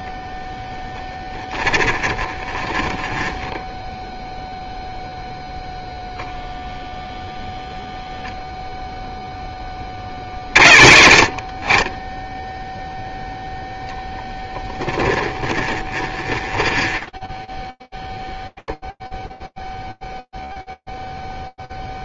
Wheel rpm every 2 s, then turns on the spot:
0, 10, 0, 0, 0, 40, 10, 10, 10, 0, 0.
2-4 14-16